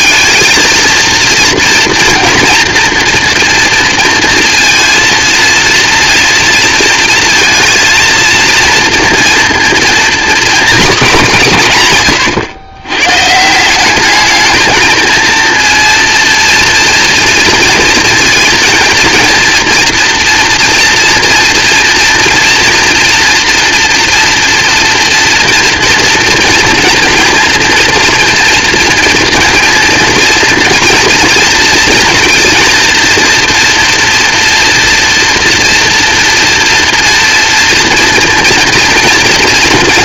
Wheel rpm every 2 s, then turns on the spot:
230, 230, 230, 230, 230, 240, 130, 220, 230, 230, 230, 240, 230, 230, 240, 230, 230, 230, 230, 230.
none